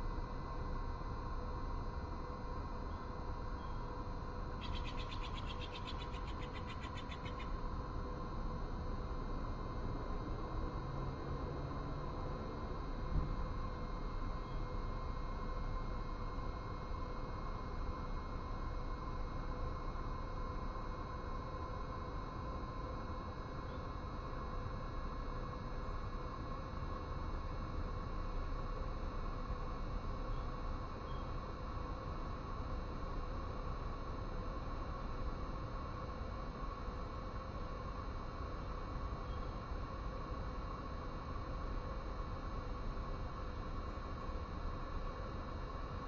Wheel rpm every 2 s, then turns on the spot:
0, 0, 0, 0, 0, 0, 0, 0, 0, 0, 0, 0, 0, 0, 0, 0, 0, 0, 0, 0, 0, 0, 0.
none